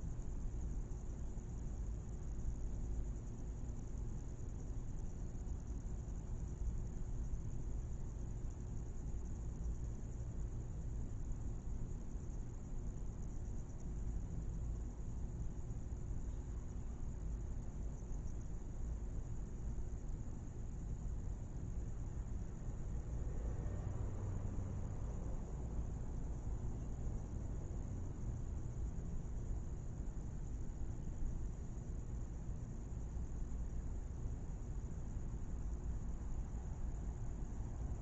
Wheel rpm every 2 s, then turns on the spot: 0, 0, 0, 0, 0, 0, 0, 0, 0, 0, 0, 0, 0, 0, 0, 0, 0, 0, 0.
none